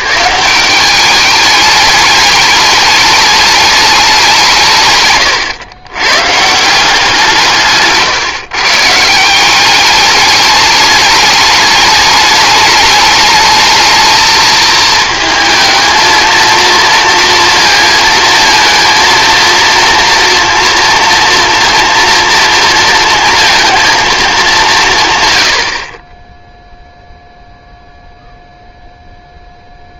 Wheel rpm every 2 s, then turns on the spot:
170, 210, 190, 140, 150, 210, 210, 220, 230, 230, 230, 230, 220, 10, 0.
none